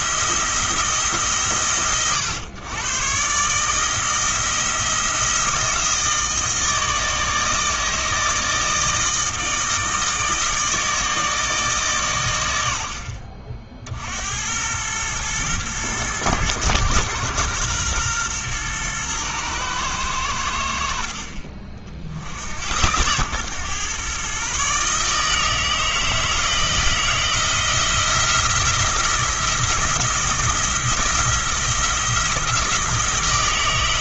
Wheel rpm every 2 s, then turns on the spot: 170, 120, 170, 160, 160, 160, 70, 100, 120, 120, 70, 90, 140, 170, 170, 170, 170.
none